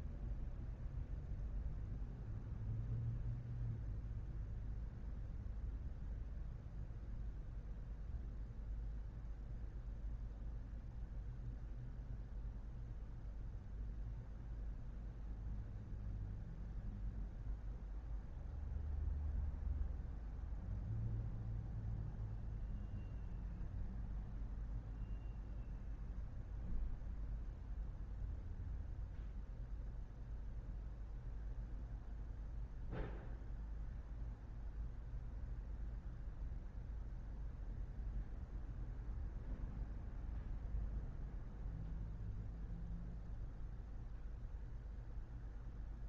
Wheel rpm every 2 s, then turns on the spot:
0, 0, 0, 0, 0, 0, 0, 0, 0, 0, 0, 0, 0, 0, 0, 0, 0, 0, 0, 0, 0, 0, 0.
none